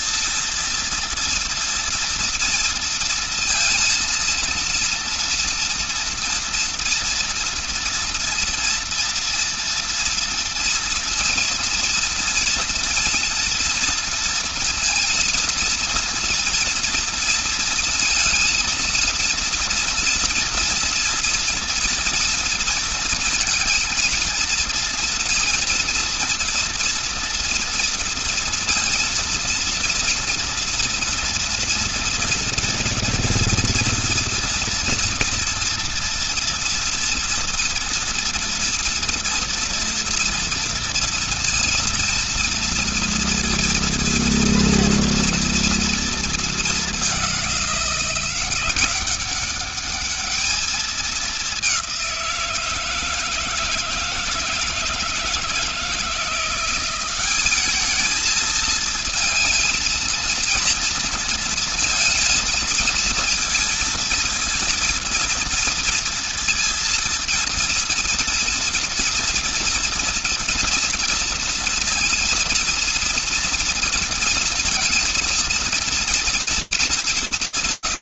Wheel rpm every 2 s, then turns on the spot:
230, 230, 230, 230, 230, 230, 230, 230, 230, 230, 240, 230, 230, 230, 230, 230, 230, 230, 230, 230, 230, 230, 230, 220, 180, 210, 180, 160, 170, 220, 230, 230, 230, 230, 230, 230, 230, 230, 220.
none